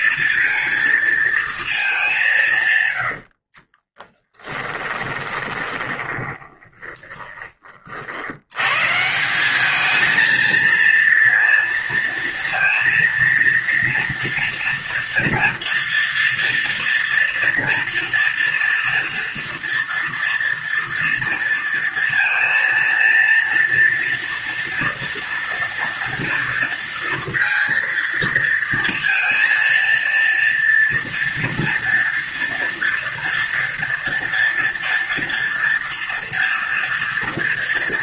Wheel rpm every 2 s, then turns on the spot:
230, 160, 20, 20, 100, 220, 230, 230, 230, 230, 230, 230, 240, 230, 230, 230, 240, 240, 230.
4-8